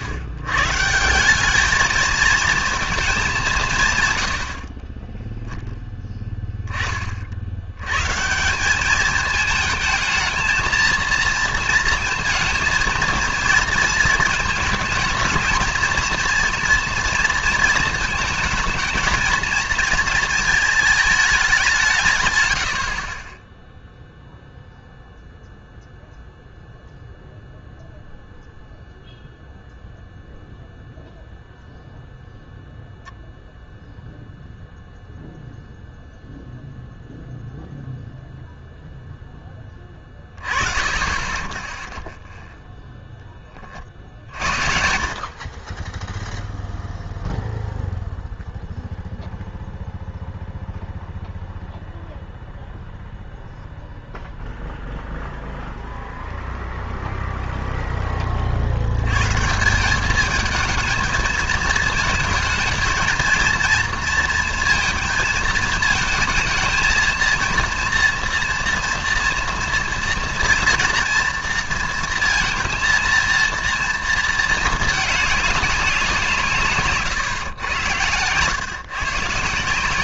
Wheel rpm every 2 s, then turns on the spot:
120, 230, 50, 10, 180, 220, 230, 230, 230, 220, 220, 80, 0, 0, 0, 0, 0, 0, 0, 0, 30, 0, 60, 0, 0, 0, 0, 0, 0, 60, 220, 220, 230, 230, 230, 230, 230, 220, 150, 130.
none